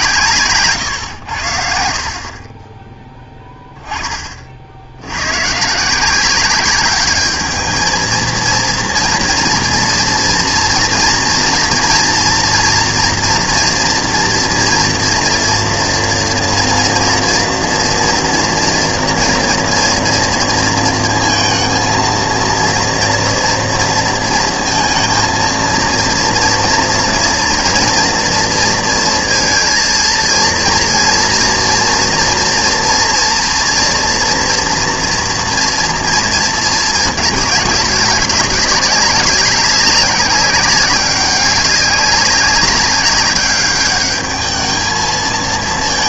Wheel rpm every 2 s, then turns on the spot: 130, 30, 50, 190, 230, 230, 240, 230, 230, 230, 230, 230, 230, 230, 230, 230, 240, 230, 230, 190, 200, 200, 210.
none